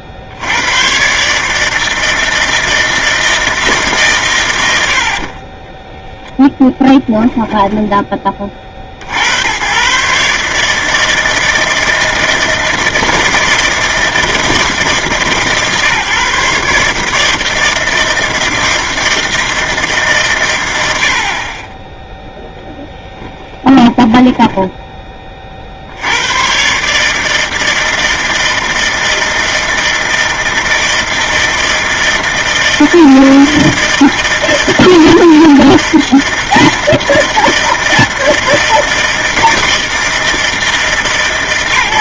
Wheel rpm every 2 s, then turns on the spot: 100, 160, 80, 10, 60, 160, 160, 150, 150, 160, 90, 10, 10, 130, 160, 160, 160, 160, 160, 160, 160.
6-8